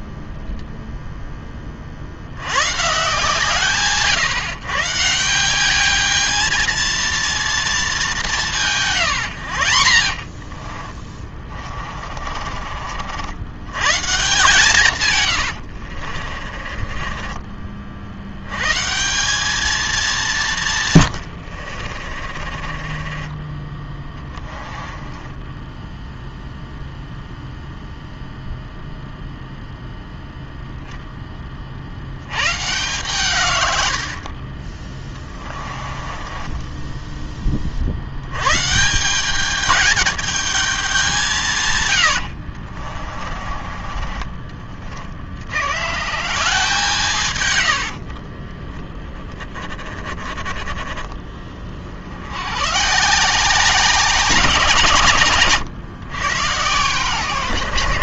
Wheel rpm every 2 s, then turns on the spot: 0, 130, 140, 230, 140, 30, 50, 130, 30, 150, 140, 30, 10, 0, 0, 0, 120, 20, 10, 170, 200, 30, 40, 160, 10, 20, 140, 160, 120.
8-12 16-18 20-26 34-38 42-44